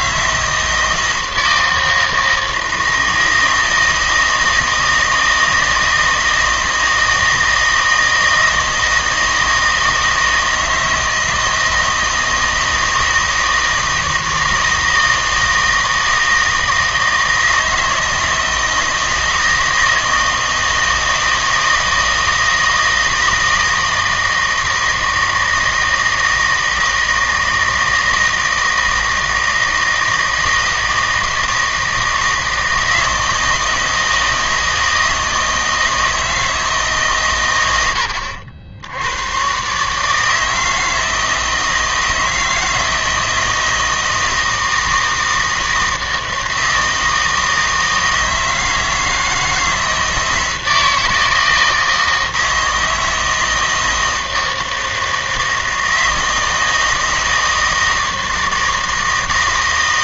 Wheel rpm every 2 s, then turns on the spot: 160, 160, 160, 160, 160, 160, 160, 160, 160, 160, 160, 160, 160, 160, 160, 160, 160, 160, 160, 80, 160, 160, 160, 160, 160, 160, 160, 160, 160, 160.
none